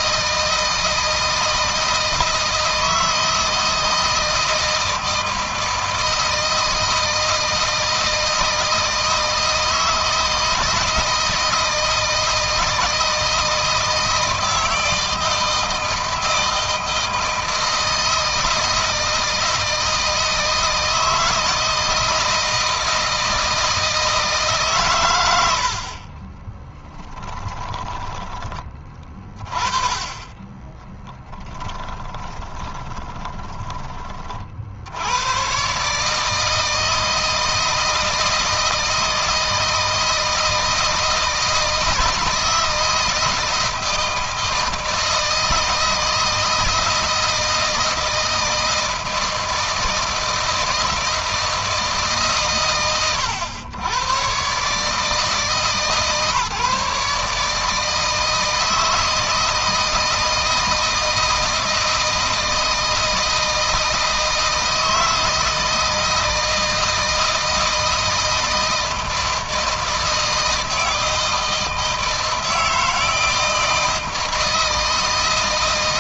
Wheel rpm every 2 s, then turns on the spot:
160, 160, 160, 160, 160, 160, 160, 160, 160, 160, 160, 160, 140, 10, 20, 10, 20, 70, 160, 160, 160, 160, 160, 160, 160, 160, 120, 140, 150, 160, 160, 160, 160, 160, 160, 160, 160, 160.
26-28 30-34